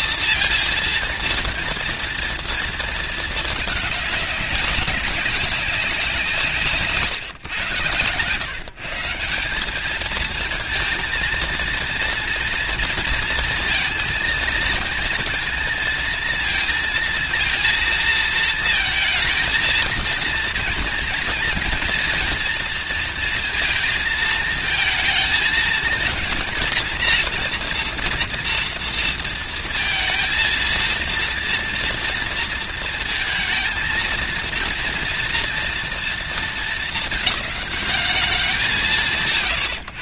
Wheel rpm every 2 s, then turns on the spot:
230, 230, 200, 160, 140, 220, 230, 230, 230, 220, 240, 230, 220, 230, 230, 230, 230, 230, 230, 190.
none